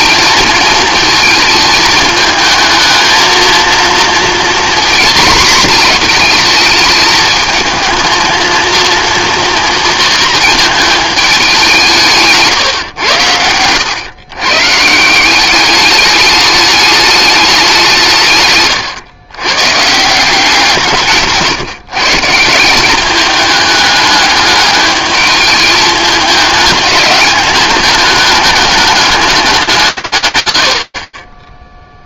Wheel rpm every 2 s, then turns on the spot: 230, 220, 240, 230, 230, 220, 140, 120, 210, 130, 170, 170, 210, 210, 210, 120.
12-14